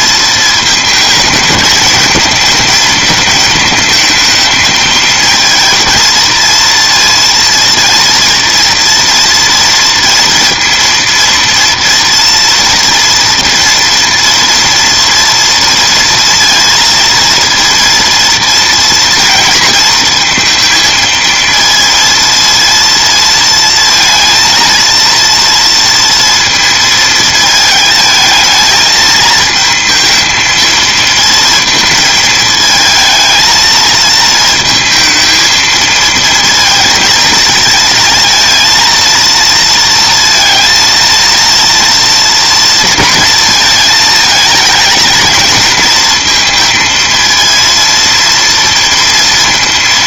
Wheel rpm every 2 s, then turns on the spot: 220, 220, 220, 230, 230, 230, 230, 230, 230, 230, 230, 230, 230, 230, 220, 220, 220, 220, 230, 230, 230, 230, 220, 220, 230.
none